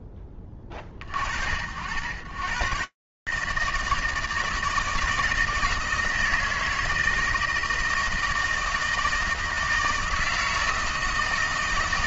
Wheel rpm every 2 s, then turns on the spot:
30, 140, 160, 160, 160, 160.
none